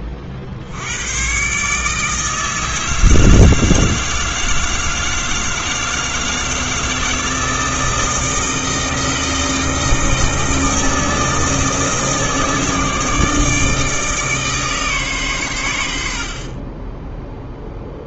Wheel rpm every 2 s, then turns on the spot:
80, 160, 160, 160, 160, 160, 160, 140, 20.
none